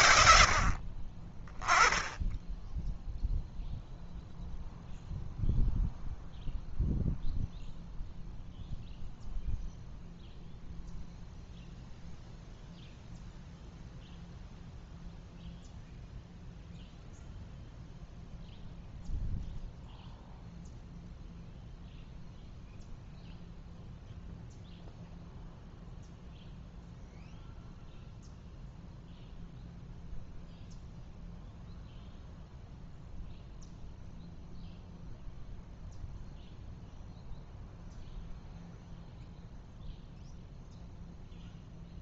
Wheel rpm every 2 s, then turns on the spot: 80, 10, 0, 0, 0, 0, 0, 0, 0, 0, 0, 0, 0, 0, 0, 0, 0, 0, 0, 0, 0.
none